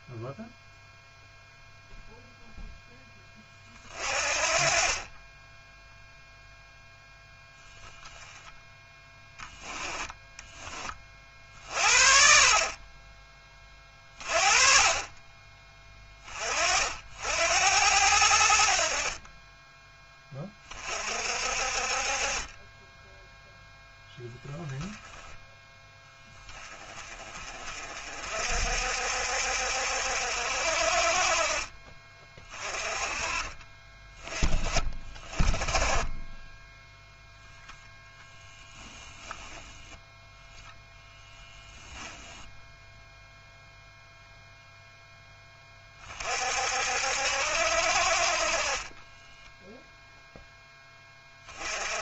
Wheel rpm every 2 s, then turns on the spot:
0, 10, 30, 0, 10, 30, 30, 30, 60, 50, 40, 10, 10, 30, 60, 50, 30, 30, 10, 10, 0, 0, 0, 60, 20, 10.
48-50